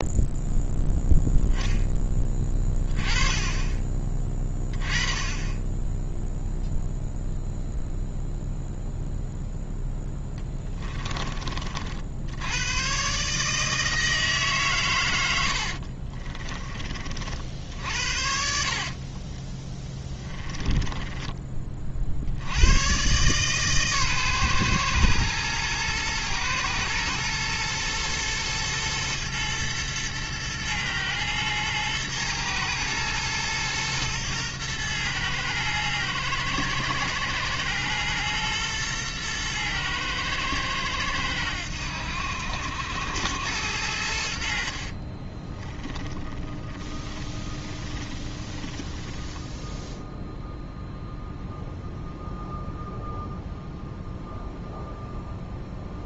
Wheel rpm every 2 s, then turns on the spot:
0, 20, 10, 0, 0, 20, 110, 120, 20, 50, 10, 110, 120, 120, 110, 110, 120, 110, 120, 110, 110, 80, 50, 20, 10, 0, 0, 0.
10-12 18-22 44-50